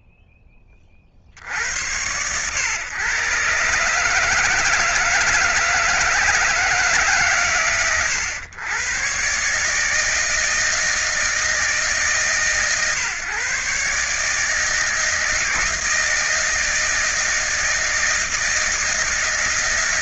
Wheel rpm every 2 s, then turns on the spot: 10, 110, 160, 160, 120, 160, 140, 150, 160, 160.
none